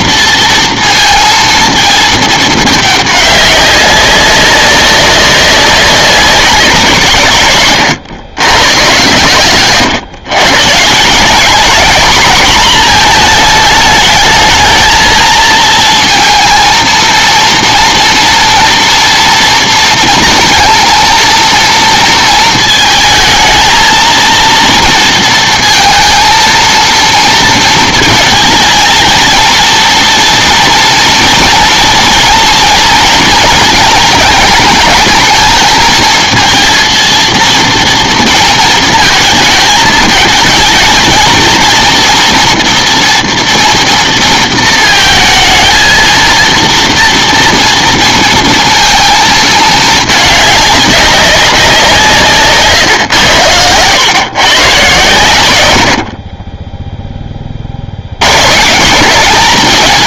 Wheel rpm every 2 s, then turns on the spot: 230, 210, 200, 180, 110, 130, 230, 220, 230, 230, 230, 220, 230, 230, 230, 240, 240, 220, 230, 230, 220, 240, 230, 230, 230, 200, 140, 140, 20, 140.
none